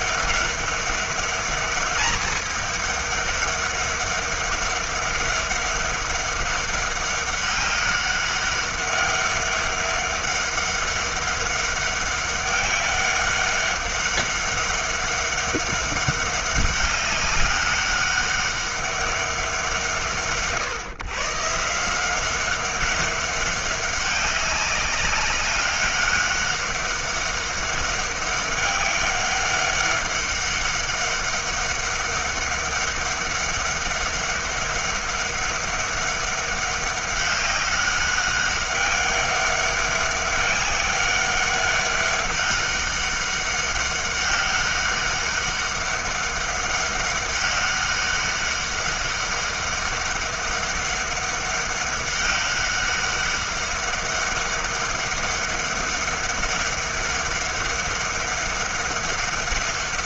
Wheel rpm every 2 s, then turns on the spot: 200, 210, 200, 200, 200, 200, 200, 200, 200, 200, 130, 200, 200, 200, 200, 200, 200, 200, 200, 200, 200, 200, 200, 200, 200, 200, 200, 200, 200, 200.
none